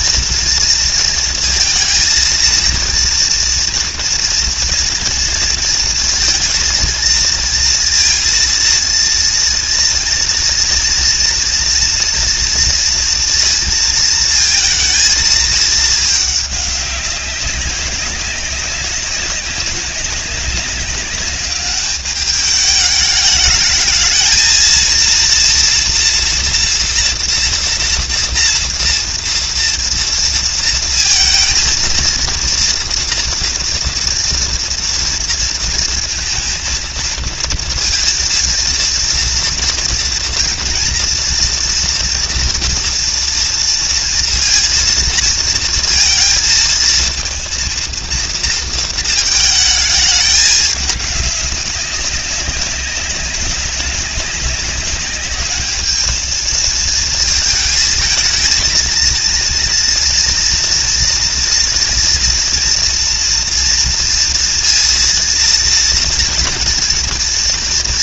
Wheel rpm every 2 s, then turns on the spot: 230, 230, 230, 230, 230, 230, 230, 230, 200, 190, 200, 210, 230, 230, 230, 230, 240, 230, 230, 230, 230, 230, 230, 230, 230, 210, 200, 200, 220, 230, 230, 230, 230, 230.
none